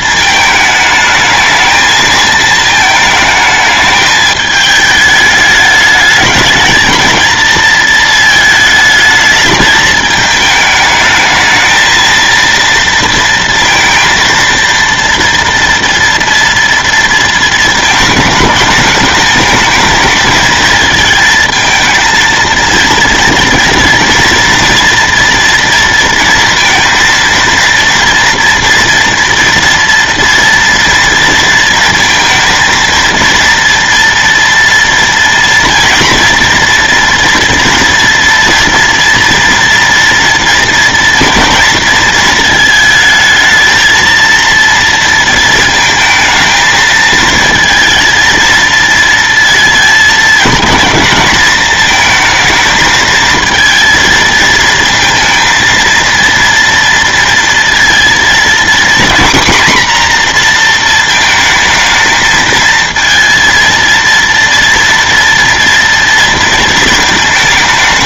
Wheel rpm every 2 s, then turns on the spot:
220, 220, 210, 220, 220, 220, 230, 230, 230, 220, 220, 230, 230, 230, 230, 230, 230, 230, 230, 230, 230, 220, 230, 220, 230, 220, 220, 230, 230, 240, 230, 230, 230, 230.
none